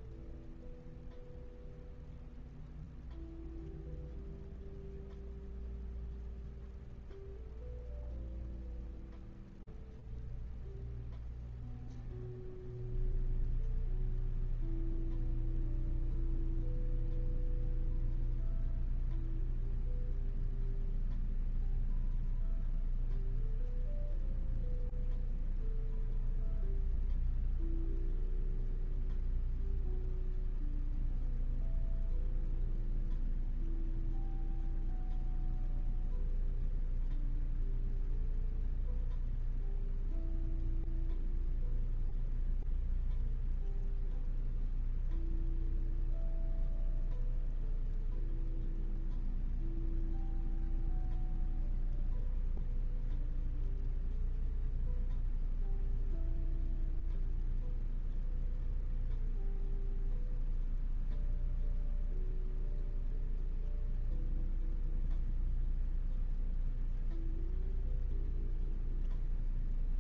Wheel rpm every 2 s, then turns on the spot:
0, 0, 0, 0, 0, 0, 0, 0, 0, 0, 0, 0, 0, 0, 0, 0, 0, 0, 0, 0, 0, 0, 0, 0, 0, 0, 0, 0, 0, 0, 0, 0, 0, 0, 0.
none